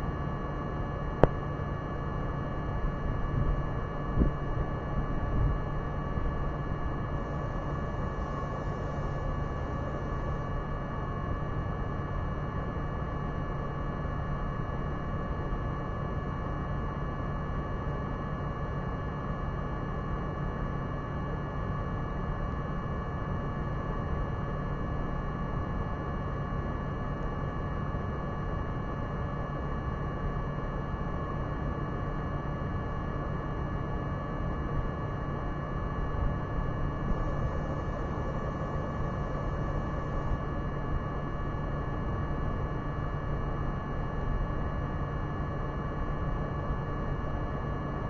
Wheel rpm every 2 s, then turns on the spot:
0, 0, 0, 0, 0, 0, 0, 0, 0, 0, 0, 0, 0, 0, 0, 0, 0, 0, 0, 0, 0, 0, 0, 0.
none